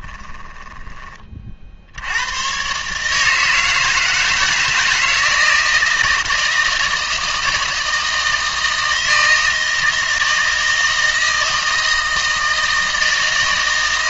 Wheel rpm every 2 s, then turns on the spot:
20, 130, 160, 160, 160, 160, 160.
0-2